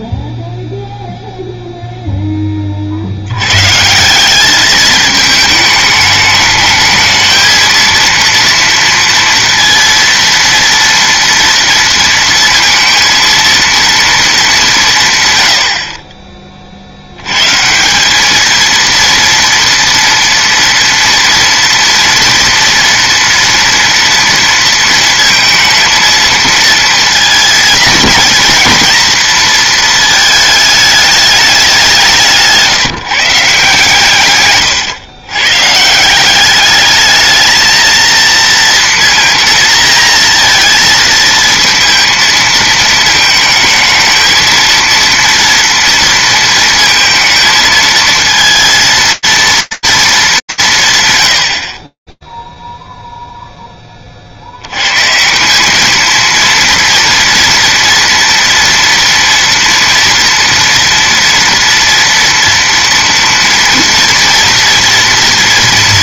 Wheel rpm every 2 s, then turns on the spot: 0, 30, 210, 220, 230, 230, 230, 180, 50, 230, 230, 230, 230, 230, 230, 210, 160, 110, 200, 230, 230, 220, 230, 230, 230, 210, 0, 100, 230, 230, 230, 230, 230.
34-36